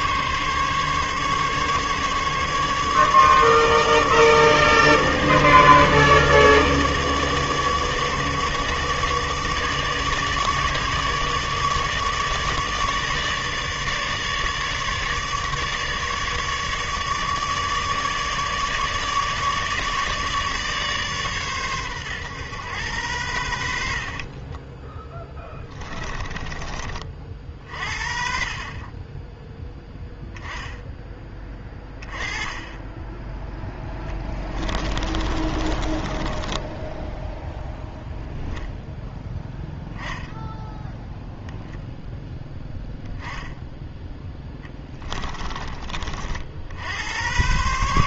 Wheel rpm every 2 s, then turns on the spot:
140, 150, 150, 150, 150, 150, 150, 150, 150, 150, 140, 100, 10, 30, 30, 10, 10, 30, 10, 0, 0, 10, 20, 80.
24-26 34-38 44-46